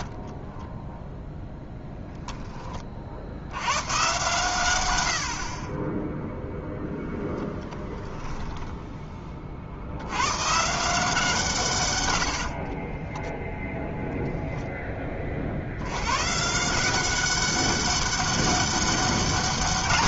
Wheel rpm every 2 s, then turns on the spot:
10, 40, 100, 0, 10, 150, 30, 20, 180, 200.
0-2 12-14